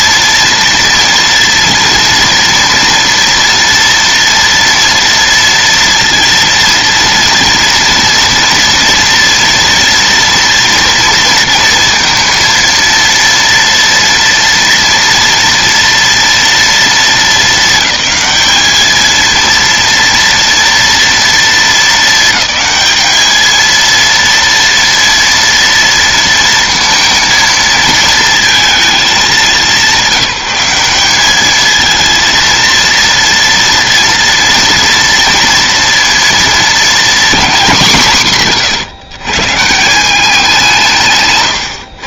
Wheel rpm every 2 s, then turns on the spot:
230, 230, 230, 230, 230, 230, 230, 230, 230, 220, 230, 220, 230, 230, 230, 190, 230, 230, 230, 150, 180.
none